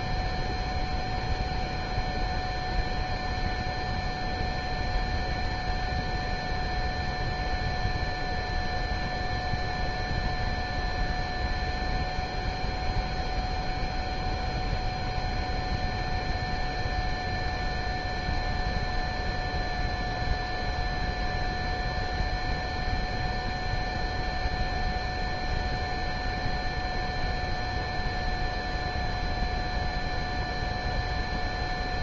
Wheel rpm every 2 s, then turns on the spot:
0, 0, 0, 0, 0, 0, 0, 0, 0, 0, 0, 0, 0, 0, 0, 0.
none